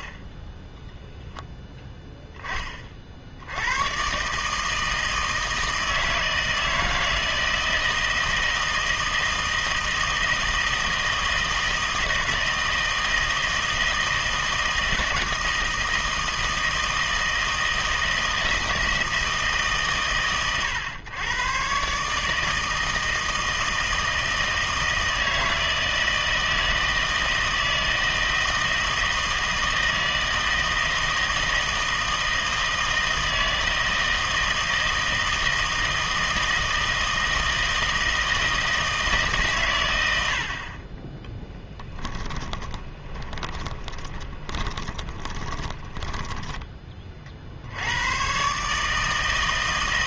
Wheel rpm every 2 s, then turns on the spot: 10, 30, 160, 160, 160, 160, 160, 160, 160, 160, 120, 160, 160, 160, 160, 160, 160, 160, 160, 160, 40, 20, 20, 20, 140.
42-46